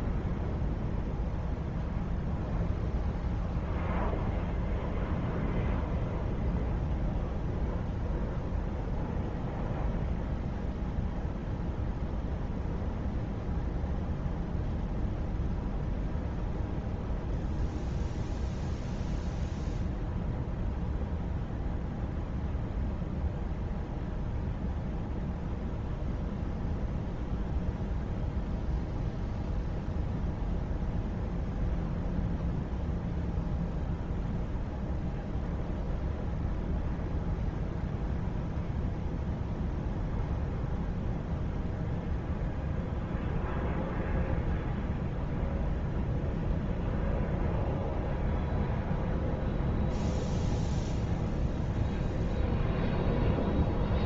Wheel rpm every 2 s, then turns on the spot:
0, 0, 0, 0, 0, 0, 0, 0, 0, 0, 0, 0, 0, 0, 0, 0, 0, 0, 0, 0, 0, 0, 0, 0, 0, 0, 0.
none